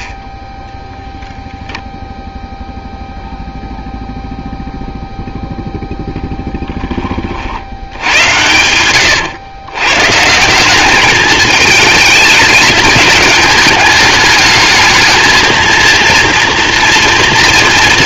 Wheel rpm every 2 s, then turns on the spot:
0, 0, 0, 10, 100, 190, 210, 210, 230.
none